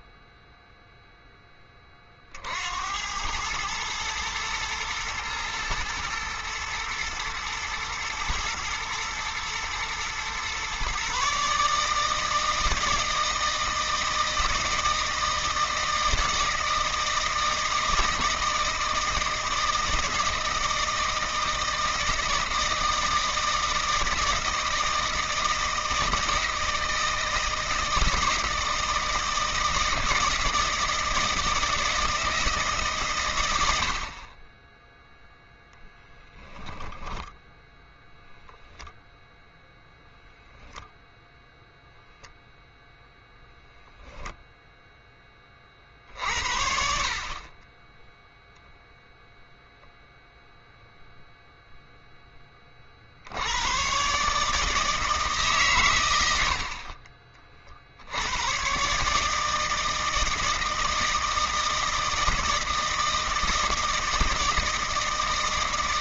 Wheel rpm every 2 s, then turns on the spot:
0, 70, 110, 110, 120, 130, 160, 160, 160, 160, 160, 160, 160, 160, 160, 160, 140, 10, 10, 0, 0, 0, 0, 60, 0, 0, 40, 150, 50, 110, 160, 170, 160.
none